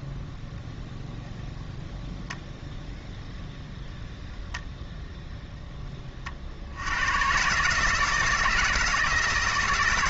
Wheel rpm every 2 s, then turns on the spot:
0, 0, 0, 70, 160.
none